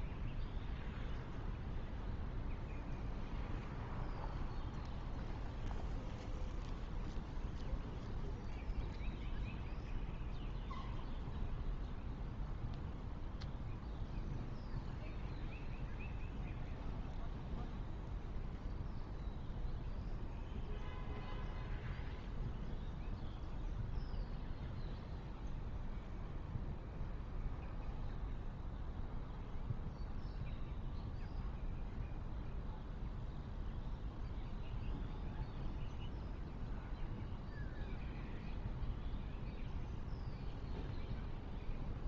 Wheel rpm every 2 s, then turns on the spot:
0, 0, 0, 0, 0, 0, 0, 0, 0, 0, 0, 0, 0, 0, 0, 0, 0, 0, 0, 0, 0.
none